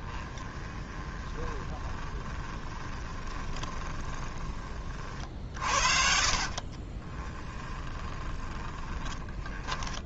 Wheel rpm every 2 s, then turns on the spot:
20, 20, 30, 40, 10.
0-4 6-10